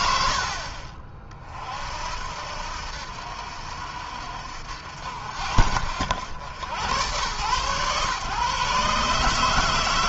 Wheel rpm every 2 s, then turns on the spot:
50, 70, 60, 90, 130.
none